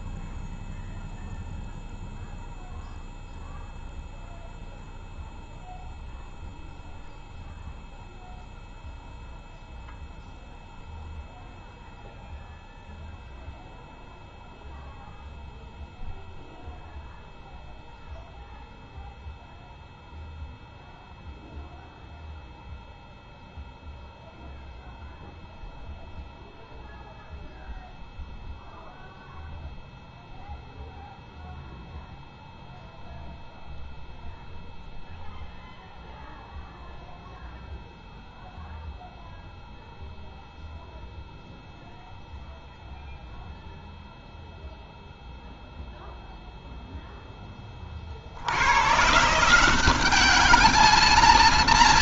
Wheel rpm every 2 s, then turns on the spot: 0, 0, 0, 0, 0, 0, 0, 0, 0, 0, 0, 0, 0, 0, 0, 0, 0, 0, 0, 0, 0, 0, 0, 0, 80, 210.
none